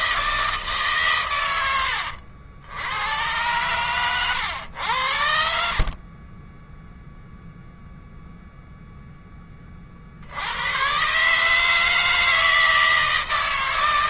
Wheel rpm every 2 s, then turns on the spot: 130, 100, 80, 0, 10, 130, 160.
none